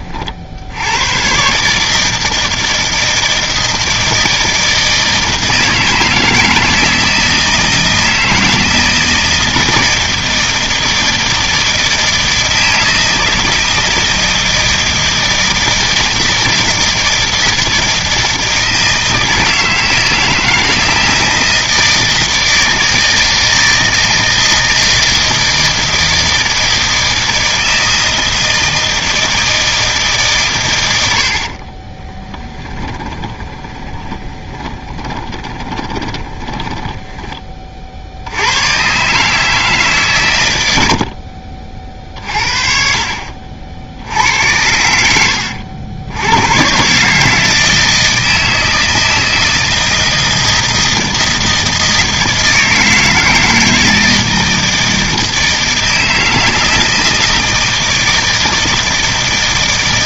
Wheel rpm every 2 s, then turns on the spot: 80, 160, 160, 160, 160, 160, 160, 160, 160, 160, 160, 160, 160, 160, 160, 110, 20, 20, 10, 120, 80, 50, 80, 130, 160, 160, 160, 160, 160, 160.
32-38